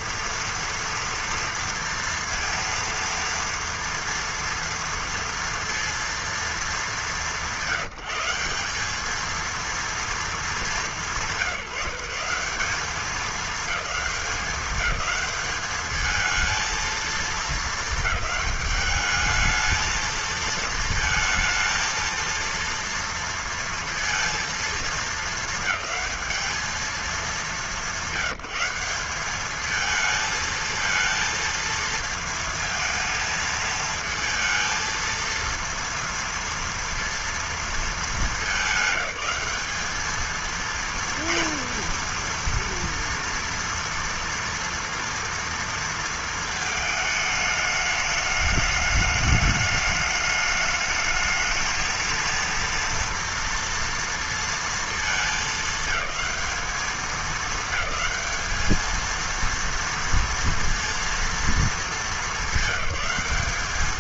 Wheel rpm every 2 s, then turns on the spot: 230, 230, 230, 200, 190, 200, 200, 210, 220, 210, 220, 230, 220, 200, 200, 230, 220, 230, 230, 200, 230, 230, 230, 220, 210, 220, 230, 220, 220, 220, 230, 200.
none